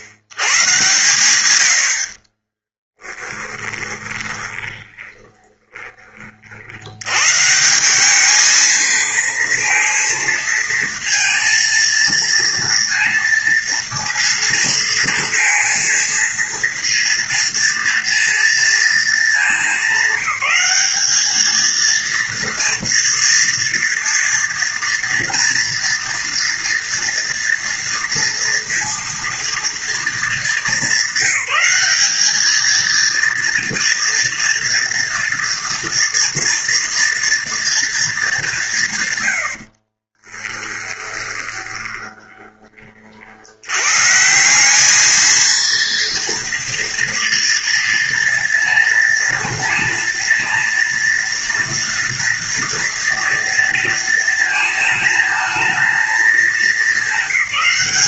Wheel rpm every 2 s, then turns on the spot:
110, 30, 30, 50, 220, 230, 230, 230, 230, 230, 190, 230, 230, 230, 230, 220, 210, 230, 240, 200, 20, 20, 180, 230, 230, 230, 230, 230, 210.
2-6 40-42